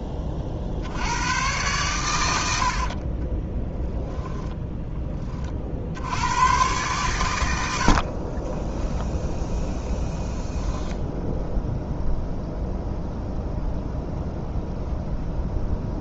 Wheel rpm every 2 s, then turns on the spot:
70, 60, 10, 120, 10, 0, 0, 0.
2-4 8-10